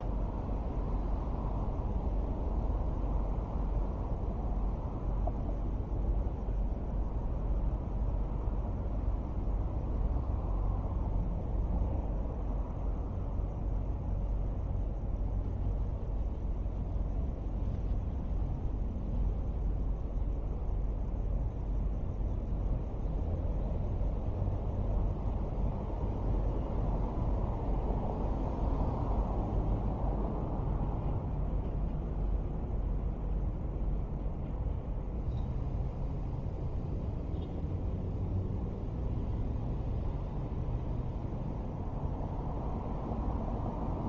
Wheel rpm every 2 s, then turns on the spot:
0, 0, 0, 0, 0, 0, 0, 0, 0, 0, 0, 0, 0, 0, 0, 0, 0, 0, 0, 0, 0, 0.
none